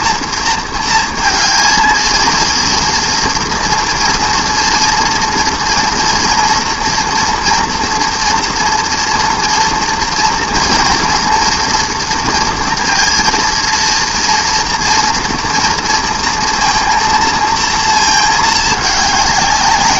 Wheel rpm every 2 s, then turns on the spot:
230, 230, 230, 240, 240, 230, 230, 230, 230, 210.
none